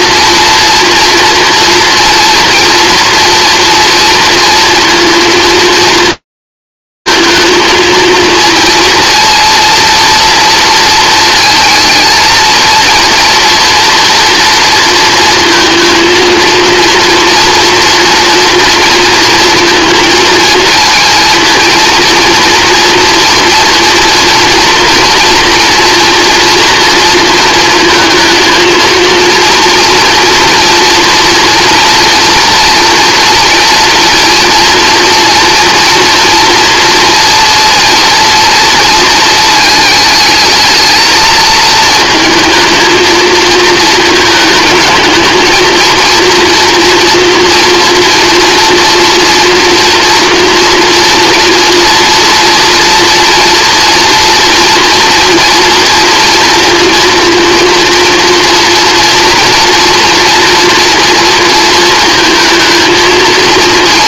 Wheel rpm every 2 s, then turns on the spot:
230, 230, 230, 230, 230, 220, 230, 230, 230, 230, 230, 240, 240, 230, 230, 230, 230, 230, 230, 220, 220, 220, 230, 240, 230, 240, 230, 240, 230, 230, 230, 230.
none